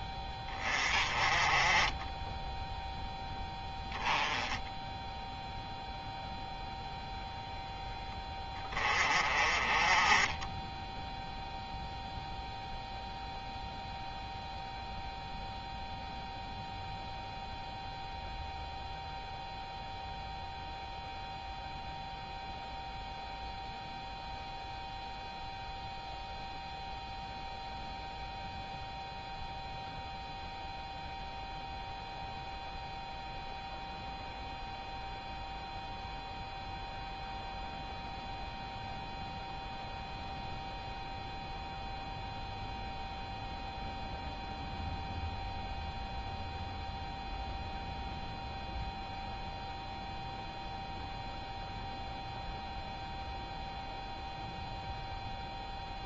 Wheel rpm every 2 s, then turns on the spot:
30, 0, 10, 0, 20, 10, 0, 0, 0, 0, 0, 0, 0, 0, 0, 0, 0, 0, 0, 0, 0, 0, 0, 0, 0, 0, 0, 0.
none